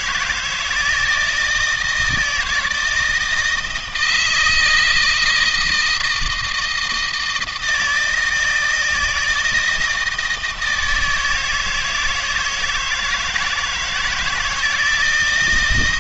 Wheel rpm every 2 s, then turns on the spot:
160, 160, 160, 160, 160, 160, 160, 160.
none